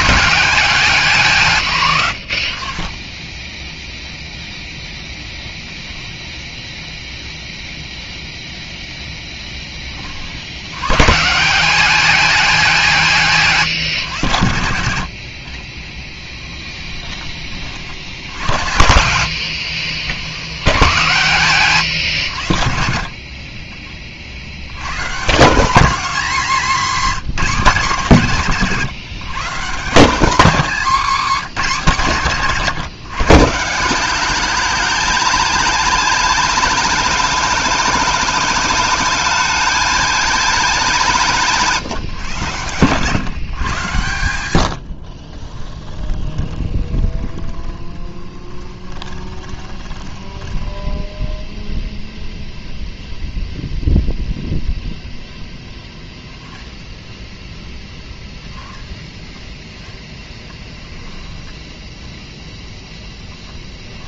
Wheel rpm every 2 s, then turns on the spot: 190, 30, 0, 0, 0, 110, 190, 100, 20, 80, 90, 60, 110, 230, 160, 170, 150, 220, 220, 210, 200, 130, 70, 20, 20, 10, 0, 0, 10, 10, 10, 0.
16-20 44-52 60-62